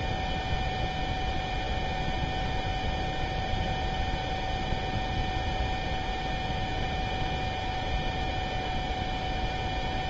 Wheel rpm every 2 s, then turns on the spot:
0, 0, 0, 0, 0.
none